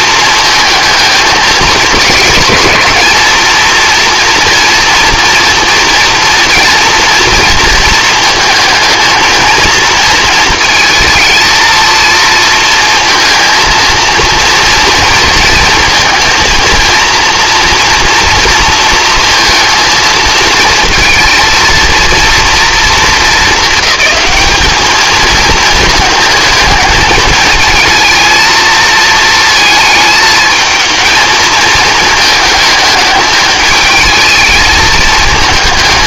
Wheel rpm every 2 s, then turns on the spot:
220, 230, 230, 230, 230, 220, 230, 230, 230, 230, 220, 230, 210, 220, 230, 220, 210, 220.
none